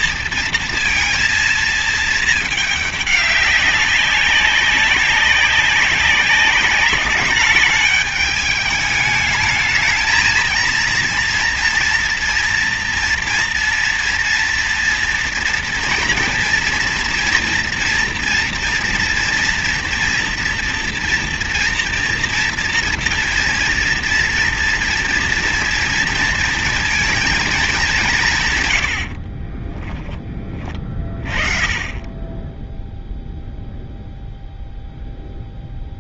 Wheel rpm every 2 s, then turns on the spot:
230, 210, 200, 200, 210, 230, 230, 230, 230, 230, 230, 230, 240, 230, 130, 30, 10, 0.
none